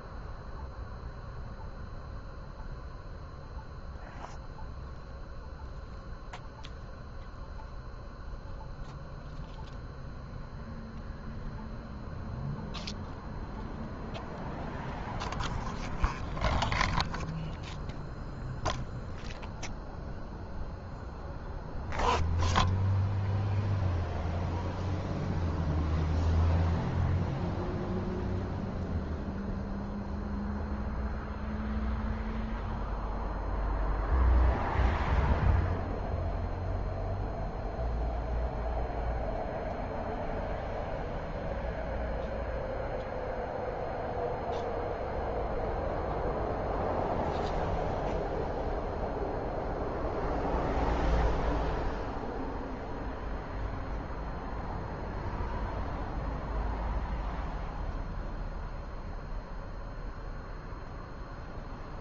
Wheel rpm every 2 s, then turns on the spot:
0, 0, 0, 0, 0, 0, 0, 0, 0, 0, 0, 0, 0, 0, 0, 0, 0, 0, 0, 0, 0, 0, 0, 0, 0, 0, 0, 0, 0, 0, 0.
none